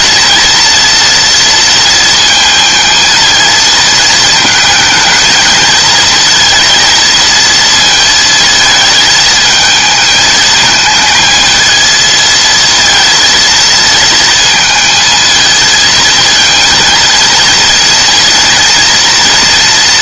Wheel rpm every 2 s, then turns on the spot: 230, 220, 220, 230, 220, 220, 230, 220, 230, 240.
none